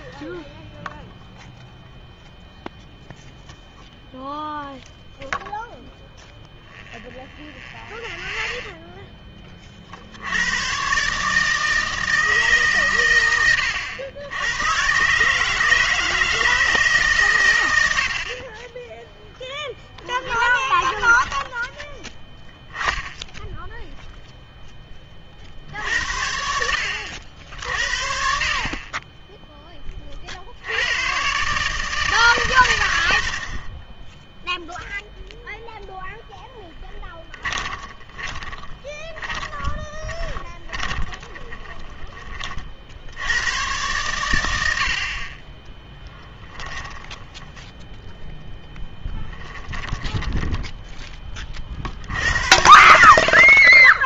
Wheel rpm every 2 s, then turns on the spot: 0, 0, 0, 0, 0, 120, 140, 110, 160, 20, 20, 10, 10, 70, 30, 80, 110, 0, 20, 20, 10, 60, 70, 10, 10, 10, 80.
20-22 36-42 46-48 52-54